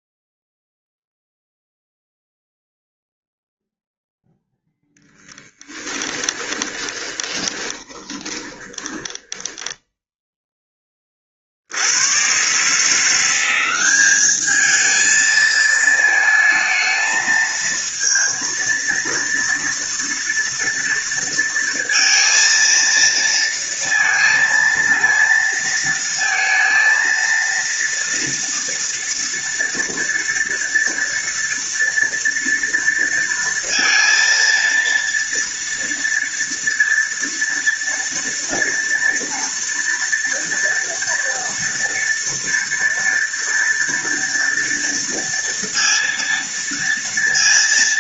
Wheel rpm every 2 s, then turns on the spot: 0, 0, 0, 20, 20, 20, 150, 220, 220, 230, 230, 230, 230, 230, 230, 230, 230, 230, 230, 230, 230, 230, 230, 230.
6-10